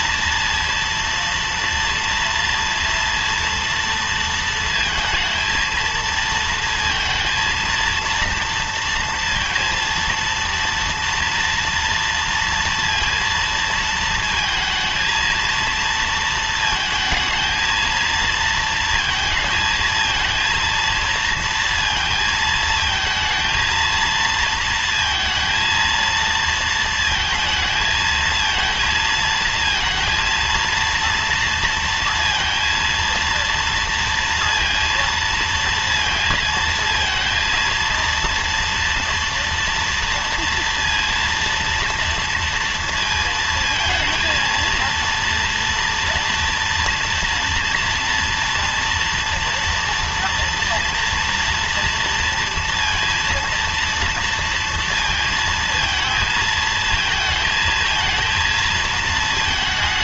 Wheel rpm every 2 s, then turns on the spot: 230, 230, 230, 230, 230, 230, 230, 220, 220, 230, 230, 220, 230, 230, 230, 230, 230, 230, 230, 230, 230, 230, 230, 240, 230, 230, 230, 230, 220, 230.
none